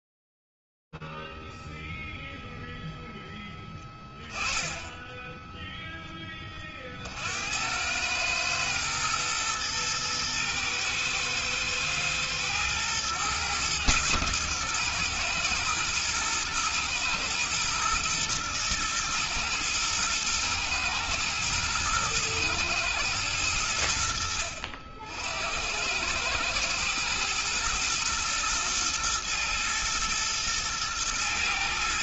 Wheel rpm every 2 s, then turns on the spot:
0, 0, 10, 60, 110, 110, 120, 120, 120, 110, 110, 90, 90, 110, 120, 110.
none